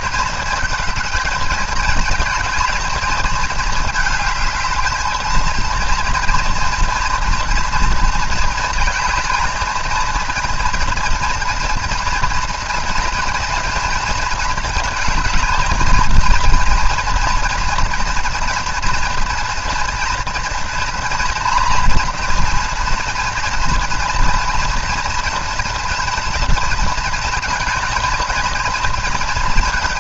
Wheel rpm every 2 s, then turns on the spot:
220, 220, 220, 230, 230, 230, 230, 220, 230, 230, 230, 230, 230, 220, 220.
none